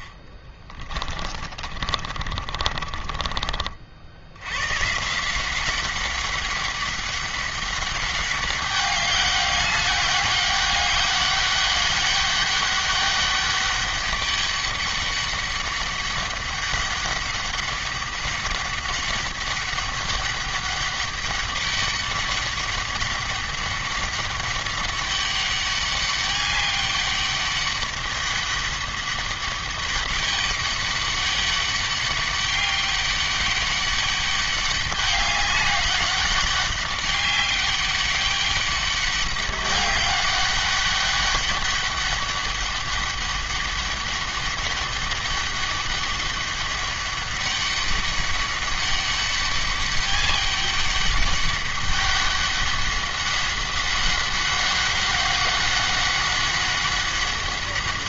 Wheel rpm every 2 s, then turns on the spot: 30, 40, 130, 200, 200, 200, 200, 200, 200, 200, 200, 200, 200, 200, 200, 200, 200, 200, 190, 200, 200, 200, 200, 200, 200, 200, 190, 190, 190.
0-4